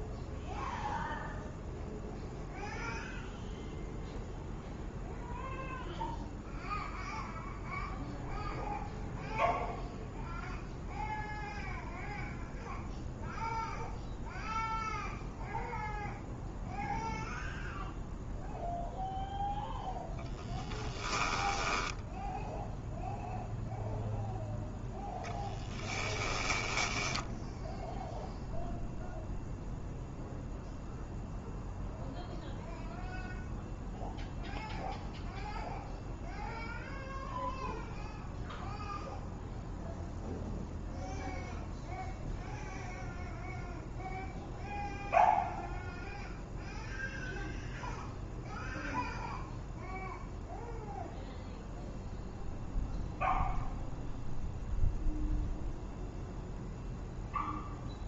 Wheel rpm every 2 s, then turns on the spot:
0, 0, 0, 0, 0, 0, 0, 0, 0, 0, 10, 0, 10, 10, 0, 0, 0, 0, 0, 0, 0, 0, 0, 0, 0, 0, 0, 0, 0.
20-22 24-28